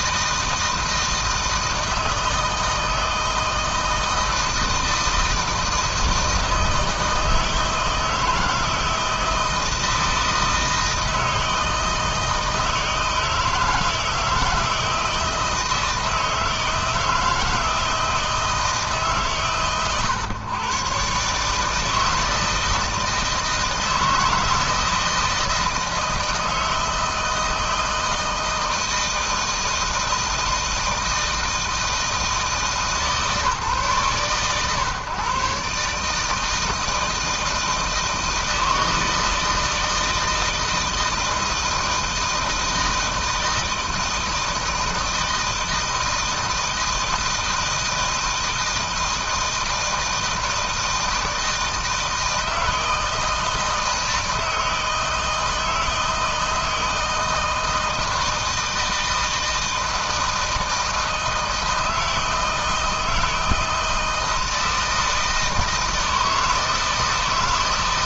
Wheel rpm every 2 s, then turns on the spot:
160, 160, 160, 160, 160, 160, 160, 160, 160, 150, 130, 160, 160, 160, 160, 160, 150, 130, 160, 160, 160, 160, 160, 160, 160, 160, 160, 160, 170, 160, 160, 160, 160, 160.
none